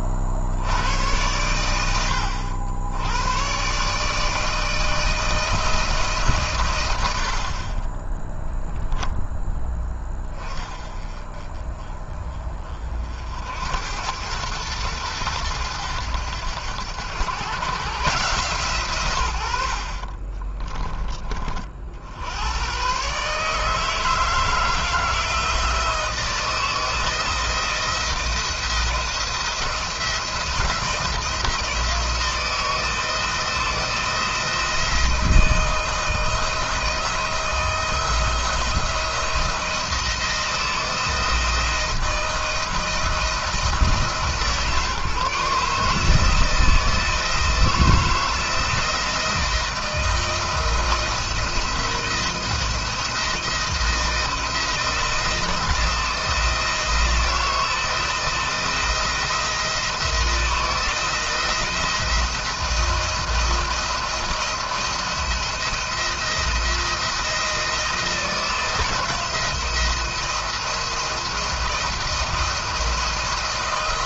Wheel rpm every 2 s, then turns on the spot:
70, 90, 150, 140, 30, 20, 30, 100, 90, 140, 30, 90, 160, 160, 170, 170, 160, 160, 160, 170, 170, 170, 160, 160, 160, 170, 170, 170, 170, 170, 170, 170, 170, 170, 170, 170, 170.
8-10 20-22